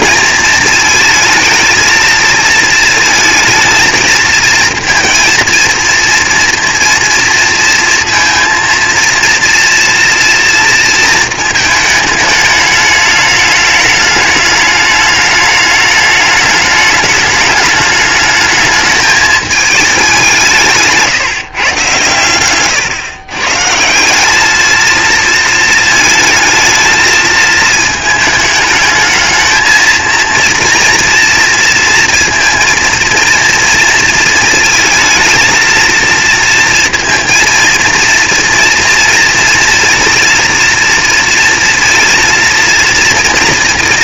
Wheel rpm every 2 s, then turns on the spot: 230, 230, 230, 230, 230, 230, 210, 210, 210, 210, 160, 120, 210, 220, 220, 230, 230, 230, 230, 230, 230, 230.
22-24